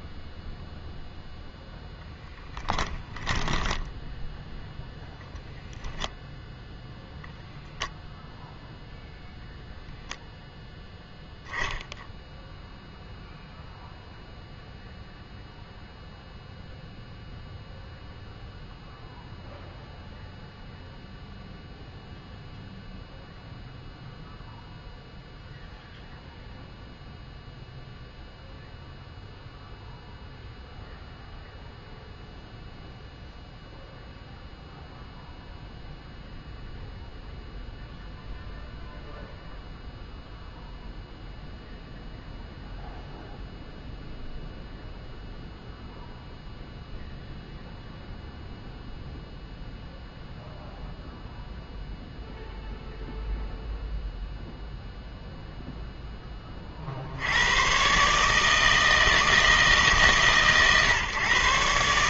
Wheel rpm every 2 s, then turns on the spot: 0, 10, 10, 0, 0, 0, 0, 0, 0, 0, 0, 0, 0, 0, 0, 0, 0, 0, 0, 0, 0, 0, 0, 0, 0, 0, 0, 0, 50, 160, 140.
2-4